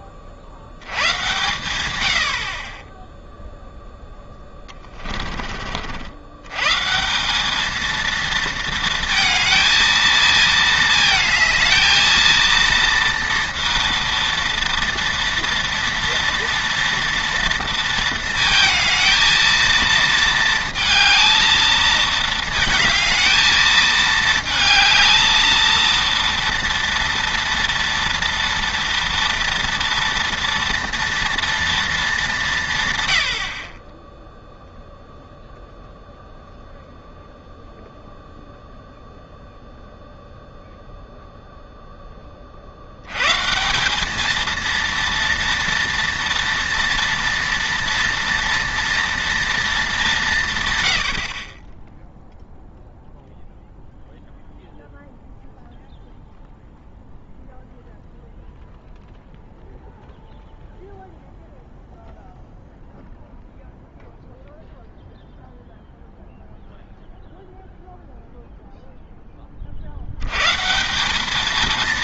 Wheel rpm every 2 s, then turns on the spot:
80, 40, 20, 130, 230, 220, 230, 230, 230, 220, 220, 220, 220, 230, 230, 230, 180, 0, 0, 0, 0, 40, 220, 230, 230, 140, 0, 0, 0, 0, 0, 0, 0, 0, 0, 140.
4-6